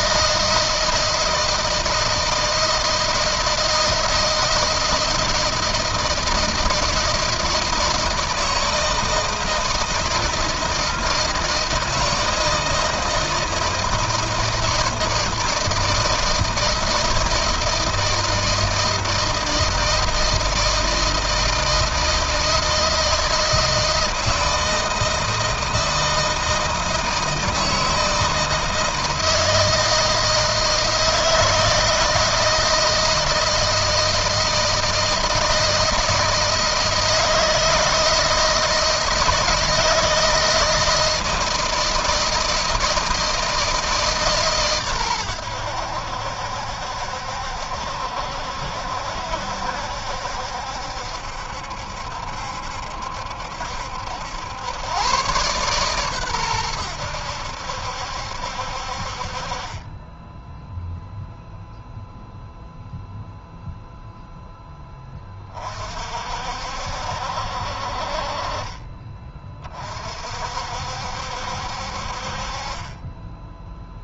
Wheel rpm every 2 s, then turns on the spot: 160, 160, 170, 170, 160, 160, 160, 160, 160, 160, 160, 160, 160, 160, 160, 160, 160, 160, 160, 160, 160, 160, 120, 70, 70, 70, 70, 110, 90, 50, 0, 0, 10, 60, 30, 60, 20.
none